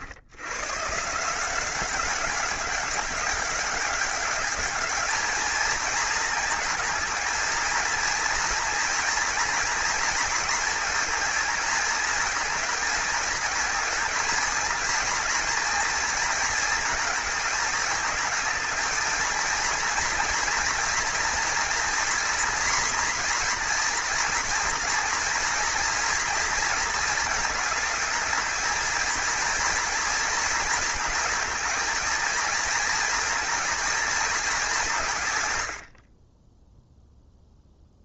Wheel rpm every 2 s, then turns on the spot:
140, 200, 210, 230, 230, 230, 230, 230, 220, 220, 230, 240, 240, 230, 230, 220, 230, 170, 0.
none